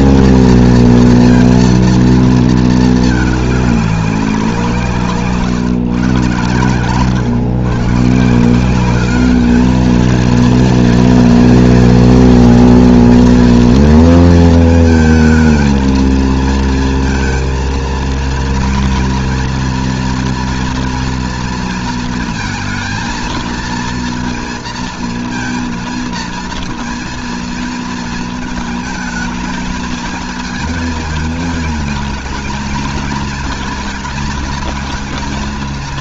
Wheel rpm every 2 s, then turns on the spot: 240, 220, 180, 120, 170, 230, 230, 230, 230, 230, 240, 230, 230, 230, 220, 220, 220, 220.
none